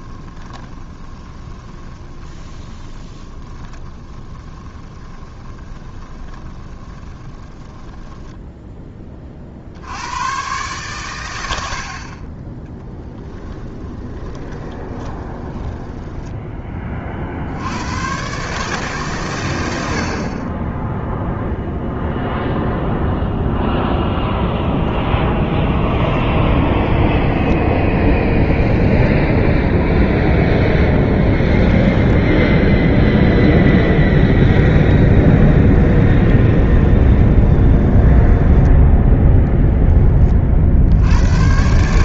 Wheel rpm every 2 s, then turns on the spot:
20, 20, 20, 20, 10, 120, 10, 20, 30, 140, 10, 0, 0, 0, 10, 0, 0, 10, 20, 10, 60.
0-8 14-16 34-38